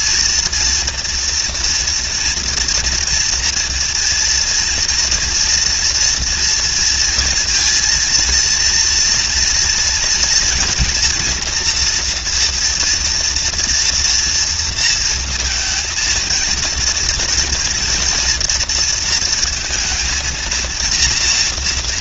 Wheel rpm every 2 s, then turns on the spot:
240, 230, 230, 230, 230, 240, 240, 230, 230, 230, 230.
none